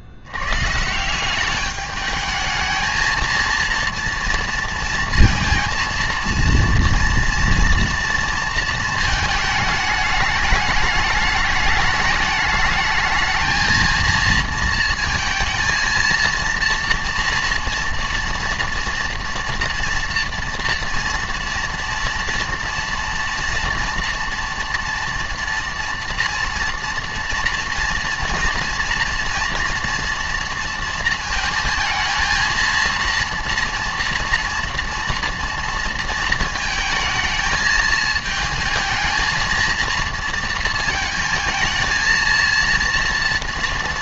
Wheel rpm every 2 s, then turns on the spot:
190, 230, 230, 230, 220, 210, 220, 230, 230, 230, 230, 230, 230, 230, 230, 230, 230, 230, 220, 230, 230, 230.
none